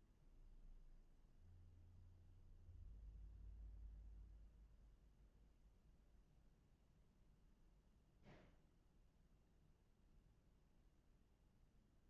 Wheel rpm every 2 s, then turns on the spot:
0, 0, 0, 0, 0, 0.
none